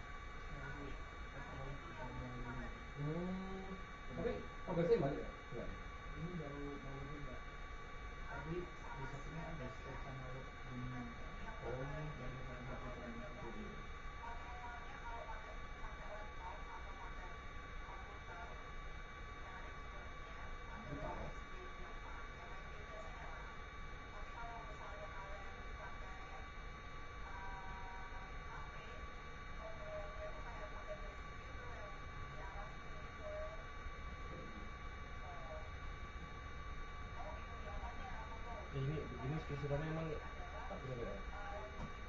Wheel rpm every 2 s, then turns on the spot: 0, 0, 0, 0, 0, 0, 0, 0, 0, 0, 0, 0, 0, 0, 0, 0, 0, 0, 0, 0, 0.
none